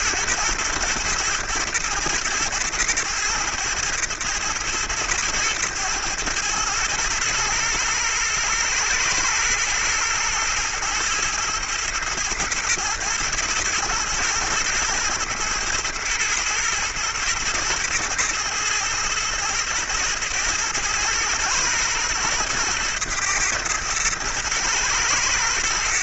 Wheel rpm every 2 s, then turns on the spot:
110, 120, 110, 110, 110, 120, 110, 110, 110, 110, 110, 120, 110.
none